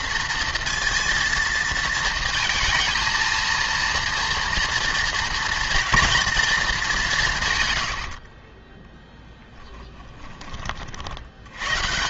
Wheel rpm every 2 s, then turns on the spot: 230, 230, 240, 220, 20, 40.
8-10